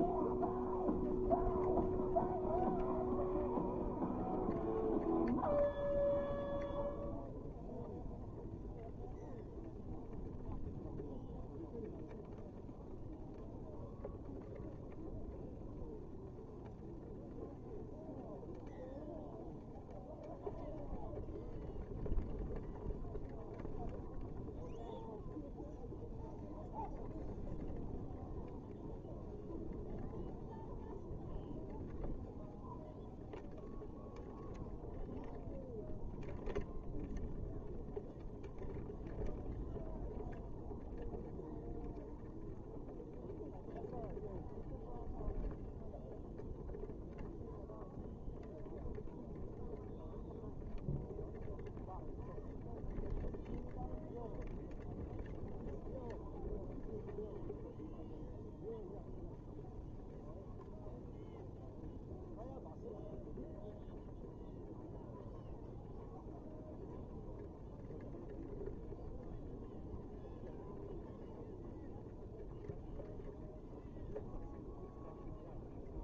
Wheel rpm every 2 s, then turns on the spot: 0, 0, 0, 0, 0, 0, 0, 0, 0, 0, 0, 0, 0, 0, 0, 0, 0, 0, 0, 0, 0, 0, 0, 0, 0, 0, 0, 0, 0, 0, 0, 0, 0, 0, 0, 0, 0, 0.
none